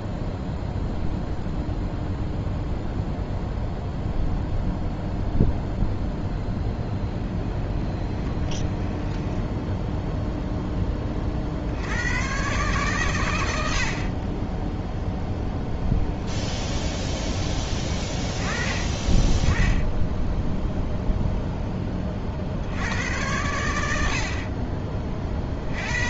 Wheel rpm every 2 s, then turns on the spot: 0, 0, 0, 20, 10, 20, 140, 0, 10, 20, 0, 90, 30.
8-10